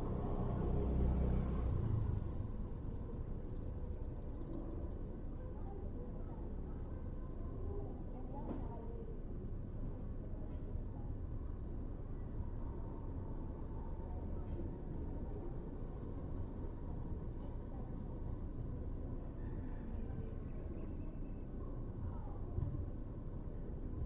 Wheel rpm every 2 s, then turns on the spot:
0, 0, 0, 0, 0, 0, 0, 0, 0, 0, 0, 0.
none